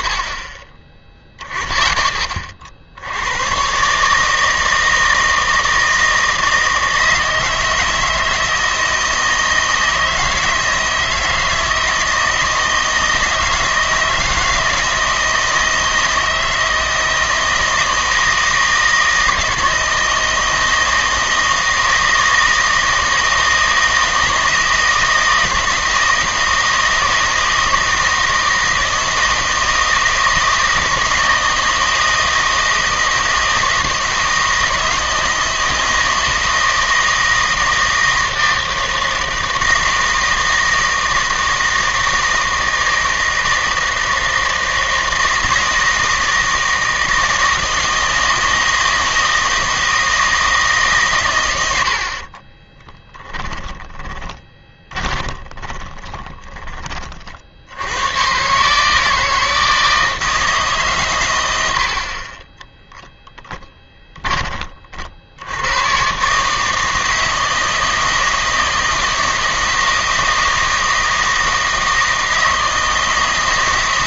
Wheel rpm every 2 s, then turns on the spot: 20, 50, 160, 160, 160, 160, 160, 160, 160, 160, 160, 160, 160, 160, 160, 160, 160, 160, 160, 160, 160, 160, 160, 160, 160, 150, 20, 30, 20, 140, 140, 10, 30, 150, 160, 160, 160.
52-56